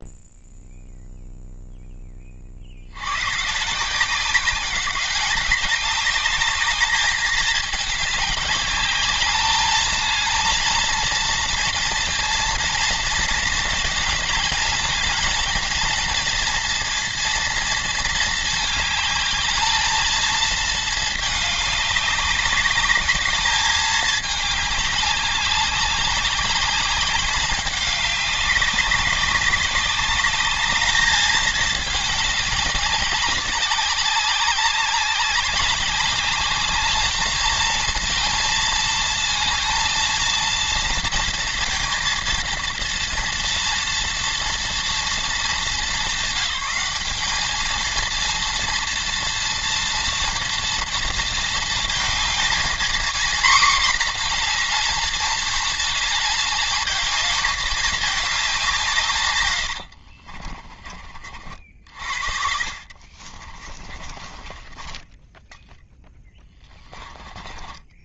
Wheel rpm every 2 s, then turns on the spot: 0, 50, 190, 210, 210, 230, 230, 220, 230, 220, 220, 200, 210, 200, 200, 210, 200, 190, 210, 220, 230, 230, 230, 200, 230, 240, 230, 230, 220, 200, 30, 50, 20, 20.
60-68